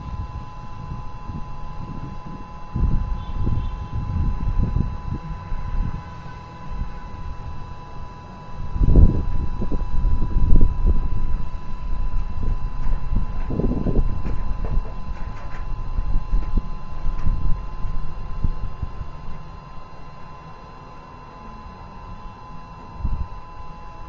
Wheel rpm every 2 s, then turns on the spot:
0, 0, 0, 0, 0, 0, 0, 0, 0, 0, 0, 0.
none